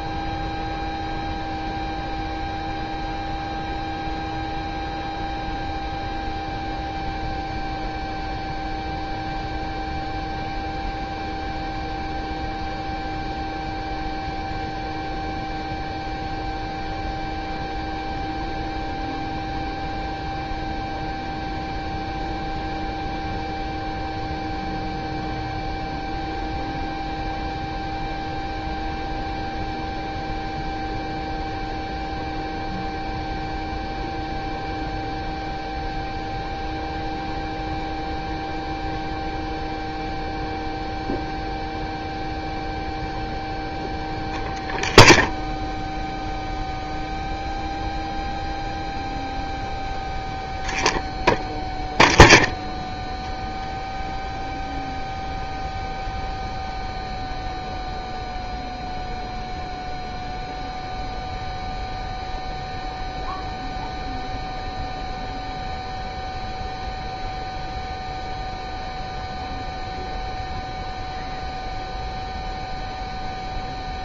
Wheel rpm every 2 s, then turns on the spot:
0, 0, 0, 0, 0, 0, 0, 0, 0, 0, 0, 0, 0, 0, 0, 0, 0, 0, 0, 0, 0, 0, 0, 0, 0, 0, 0, 0, 0, 0, 0, 0, 0, 0, 0, 0, 0.
none